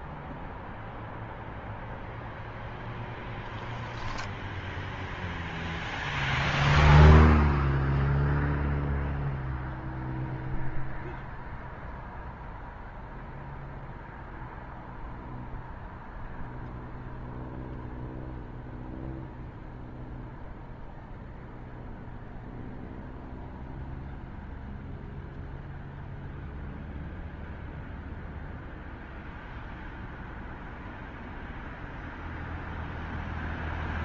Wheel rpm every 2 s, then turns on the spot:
0, 0, 0, 0, 0, 0, 0, 0, 0, 0, 0, 0, 0, 0, 0, 0, 0.
none